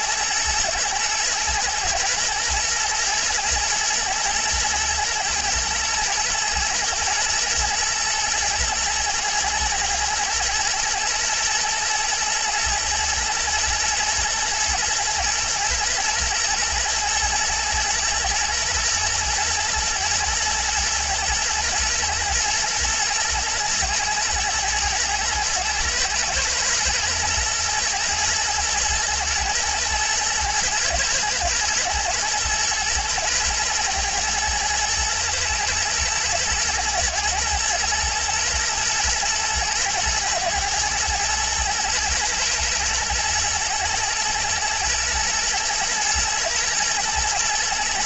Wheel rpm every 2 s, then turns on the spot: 120, 110, 110, 110, 110, 110, 120, 110, 120, 120, 110, 110, 120, 120, 120, 110, 110, 120, 120, 110, 110, 110, 110, 120.
none